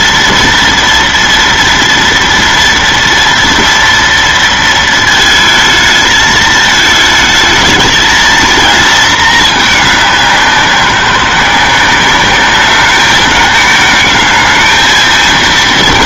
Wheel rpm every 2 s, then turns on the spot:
230, 230, 220, 220, 230, 180, 210, 220.
none